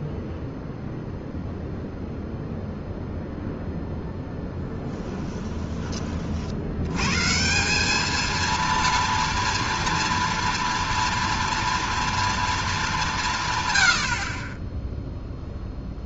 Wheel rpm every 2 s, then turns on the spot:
0, 0, 10, 80, 230, 230, 230, 0.
none